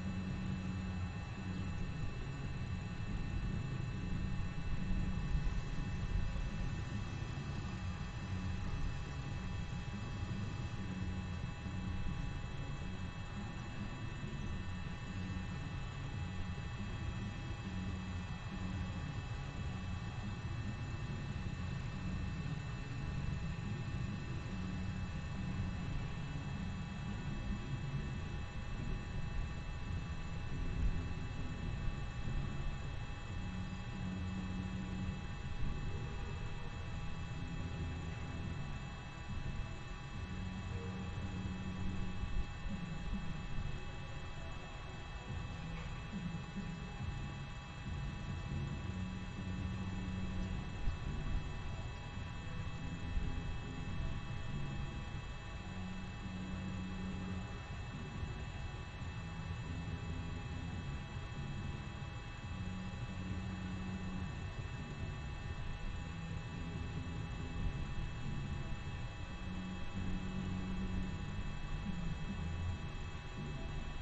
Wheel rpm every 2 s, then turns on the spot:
0, 0, 0, 0, 0, 0, 0, 0, 0, 0, 0, 0, 0, 0, 0, 0, 0, 0, 0, 0, 0, 0, 0, 0, 0, 0, 0, 0, 0, 0, 0, 0, 0, 0, 0, 0, 0.
none